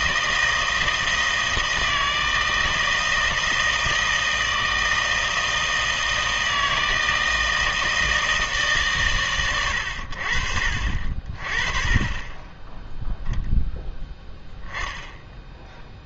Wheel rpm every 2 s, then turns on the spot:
160, 160, 160, 160, 150, 50, 10, 10.
none